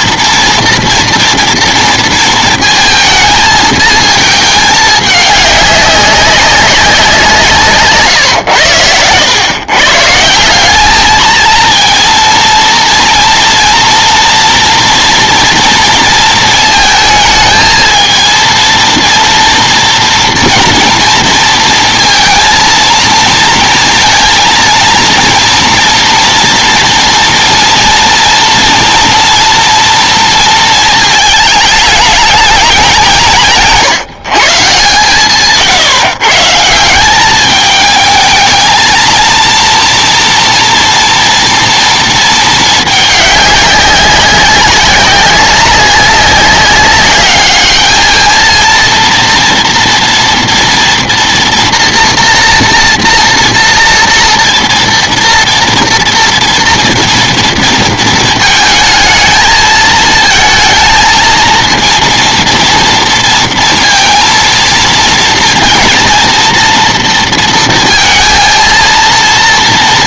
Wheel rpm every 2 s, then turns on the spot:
230, 220, 210, 190, 100, 200, 230, 240, 220, 230, 230, 230, 230, 230, 240, 220, 200, 140, 170, 220, 230, 210, 190, 200, 230, 240, 230, 240, 230, 220, 220, 230, 230, 230, 230.
none